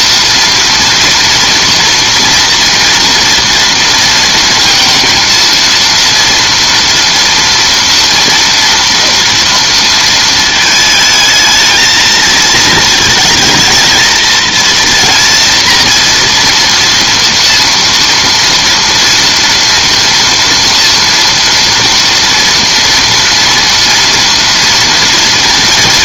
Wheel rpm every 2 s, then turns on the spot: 230, 230, 230, 230, 240, 220, 220, 230, 240, 230, 230, 230, 230.
none